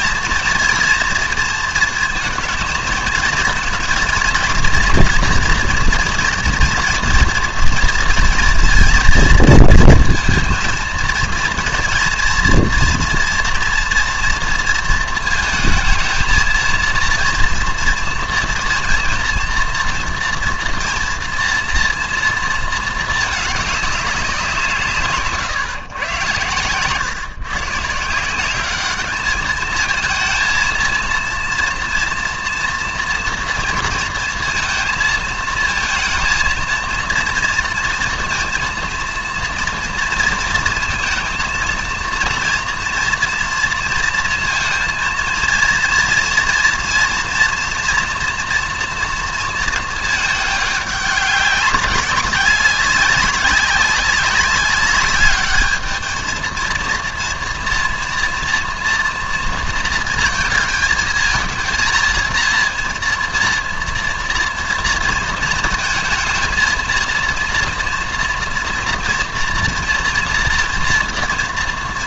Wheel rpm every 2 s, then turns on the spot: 230, 230, 230, 240, 230, 230, 230, 230, 230, 230, 230, 220, 160, 120, 200, 220, 230, 230, 230, 230, 230, 230, 230, 230, 240, 210, 190, 200, 230, 230, 220, 230, 230, 220, 230, 230.
26-28